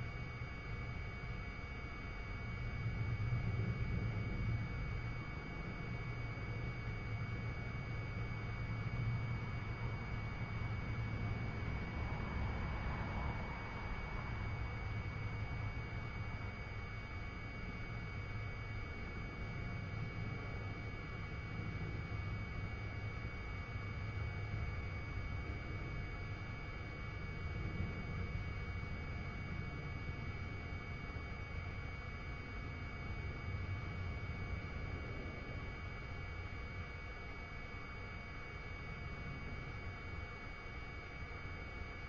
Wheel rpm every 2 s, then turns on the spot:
0, 0, 0, 0, 0, 0, 0, 0, 0, 0, 0, 0, 0, 0, 0, 0, 0, 0, 0, 0, 0.
none